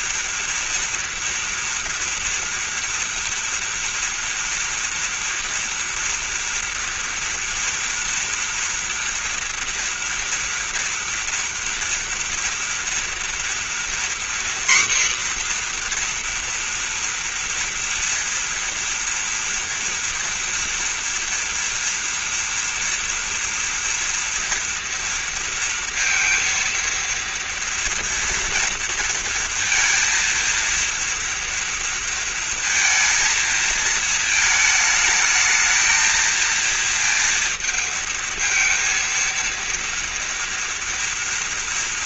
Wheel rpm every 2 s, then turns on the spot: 230, 230, 230, 230, 230, 230, 230, 250, 240, 230, 240, 230, 230, 230, 230, 230, 230, 220, 230, 230, 230.
none